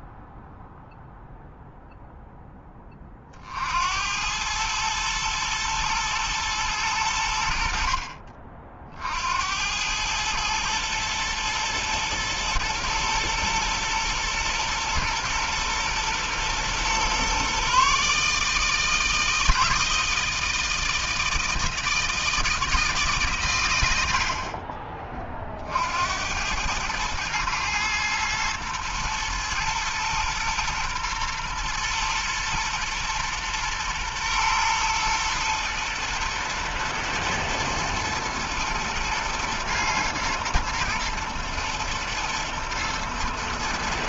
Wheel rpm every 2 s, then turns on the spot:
0, 30, 110, 90, 60, 110, 110, 120, 120, 160, 160, 150, 40, 110, 110, 120, 120, 120, 120, 110, 110, 120.
none